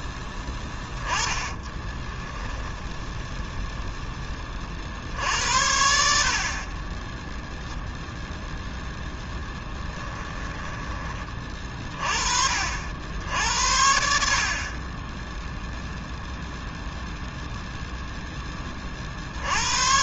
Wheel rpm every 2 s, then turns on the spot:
10, 0, 30, 50, 0, 10, 50, 40, 0, 20.
0-2 10-12